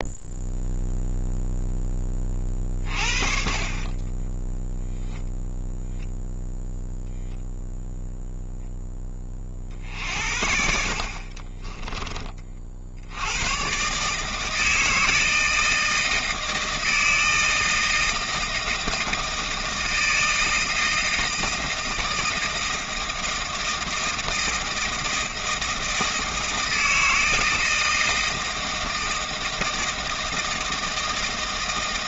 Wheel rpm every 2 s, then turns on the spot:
0, 50, 0, 0, 10, 60, 70, 160, 160, 160, 160, 160, 160, 160, 160, 160.
none